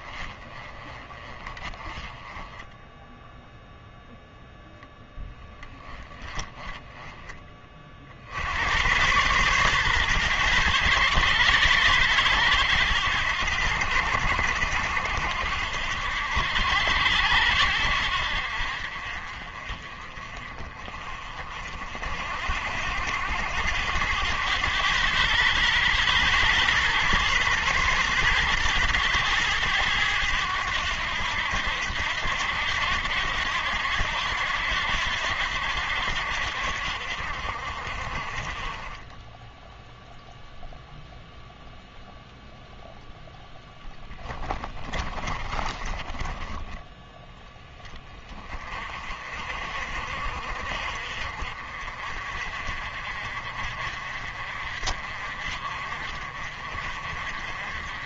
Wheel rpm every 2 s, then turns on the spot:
20, 10, 0, 10, 100, 110, 90, 70, 80, 50, 40, 70, 100, 110, 110, 90, 80, 80, 60, 20, 0, 0, 20, 20, 40, 50, 50, 50, 50.
44-46